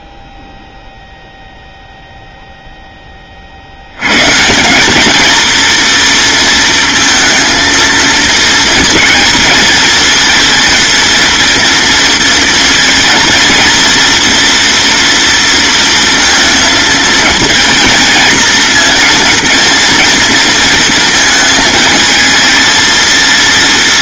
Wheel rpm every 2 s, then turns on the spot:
0, 10, 210, 230, 220, 230, 230, 230, 220, 230, 230, 230.
none